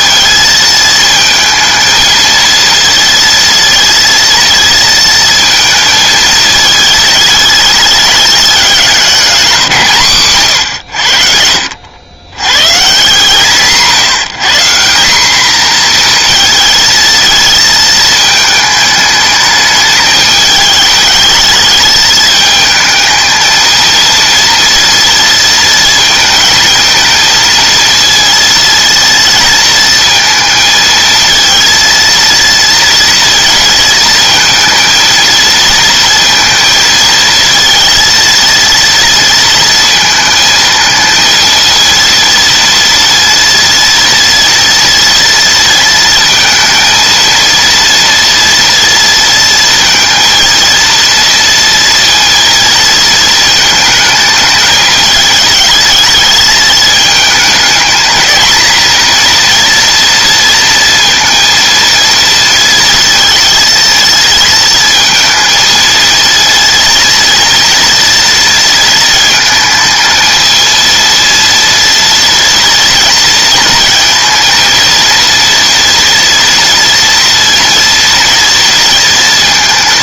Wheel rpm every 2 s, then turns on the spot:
220, 230, 230, 220, 200, 90, 140, 190, 230, 210, 210, 220, 230, 220, 230, 220, 230, 230, 230, 230, 230, 230, 230, 230, 230, 230, 230, 220, 220, 230, 230, 230, 230, 230, 230, 230, 230, 230, 230, 230.
none